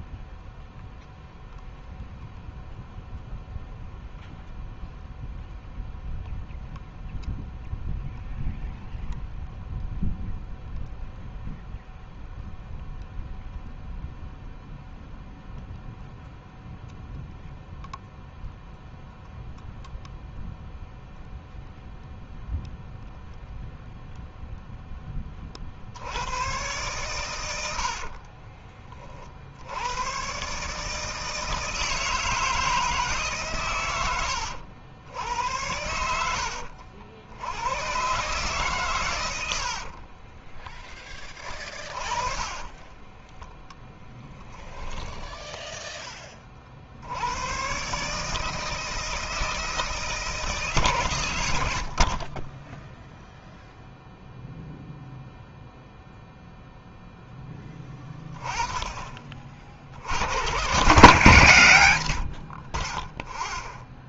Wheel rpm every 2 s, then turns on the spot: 0, 0, 0, 0, 0, 0, 0, 0, 0, 0, 0, 0, 10, 120, 50, 150, 160, 80, 80, 140, 30, 20, 10, 50, 160, 130, 10, 0, 0, 20, 130, 20.
42-44